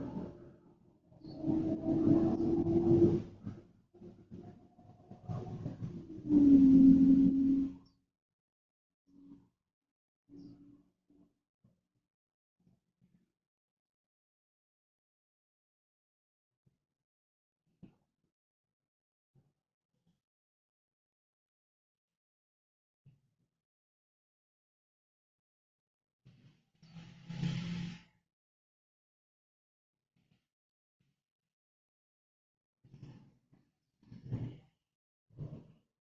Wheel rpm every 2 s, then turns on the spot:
0, 0, 0, 0, 0, 0, 0, 0, 0, 0, 0, 0, 0, 0, 0, 0, 0, 0.
none